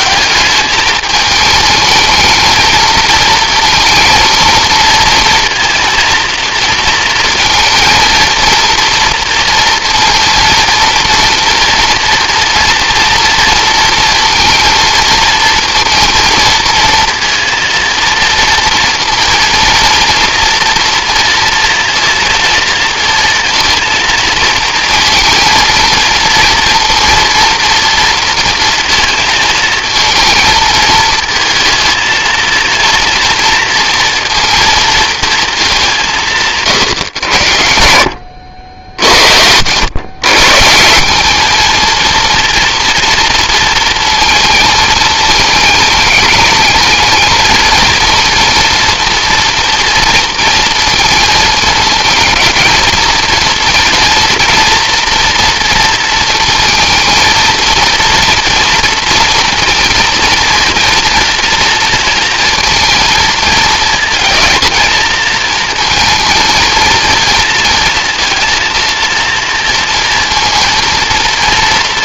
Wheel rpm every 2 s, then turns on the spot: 200, 220, 220, 230, 230, 230, 230, 230, 230, 230, 230, 230, 230, 230, 230, 220, 230, 230, 160, 80, 150, 230, 230, 210, 230, 230, 220, 230, 230, 230, 230, 230, 230, 230, 230, 230.
38-40